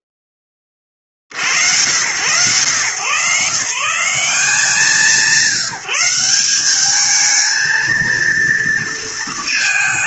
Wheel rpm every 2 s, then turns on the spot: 40, 120, 180, 210, 220.
none